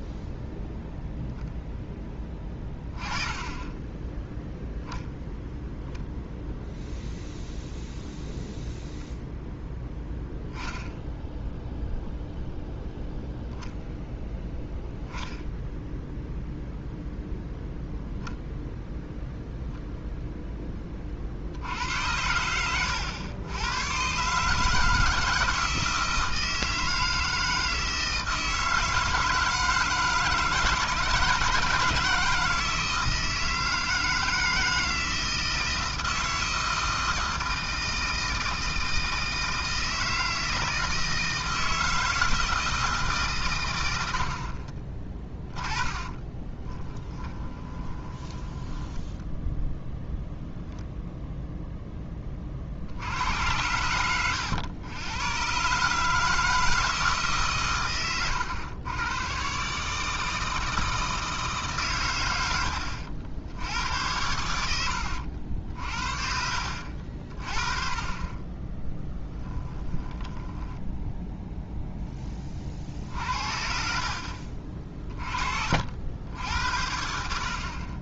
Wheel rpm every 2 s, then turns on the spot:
0, 20, 0, 0, 0, 0, 0, 10, 0, 0, 20, 100, 150, 160, 160, 160, 160, 160, 160, 160, 160, 160, 40, 20, 10, 0, 60, 100, 160, 110, 160, 70, 80, 50, 10, 10, 50, 40, 70.
46-50 70-72